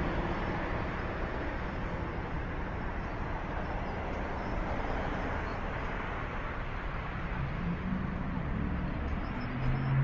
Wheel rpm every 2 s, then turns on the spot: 0, 0, 0, 0, 0.
none